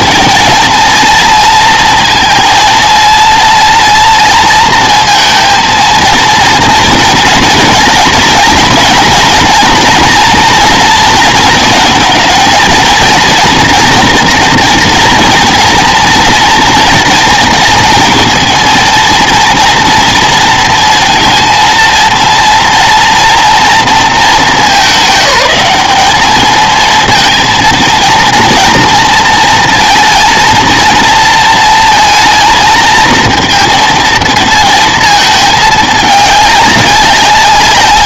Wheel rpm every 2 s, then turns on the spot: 230, 230, 230, 230, 230, 230, 230, 240, 230, 230, 230, 230, 210, 220, 230, 230, 220, 220, 200.
none